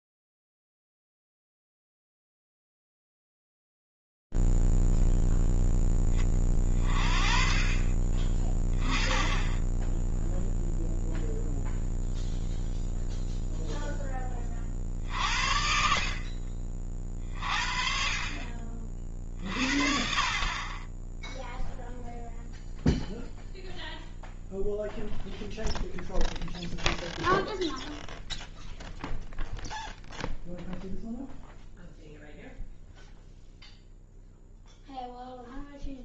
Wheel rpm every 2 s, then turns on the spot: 0, 0, 0, 10, 30, 0, 0, 20, 50, 50, 20, 0, 0, 0, 0, 0, 0, 0.
none